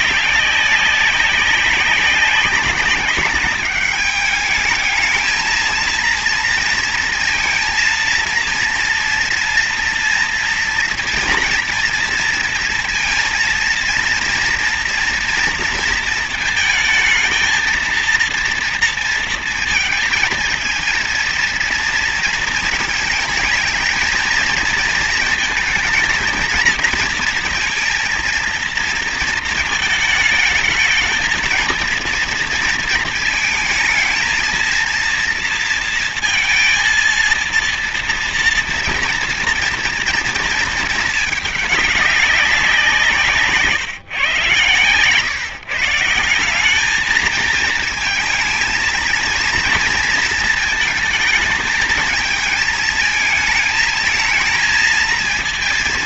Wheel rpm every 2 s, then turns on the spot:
200, 200, 210, 230, 230, 230, 230, 230, 230, 230, 220, 230, 230, 230, 230, 220, 230, 230, 230, 230, 230, 190, 130, 190, 220, 230, 220, 230.
none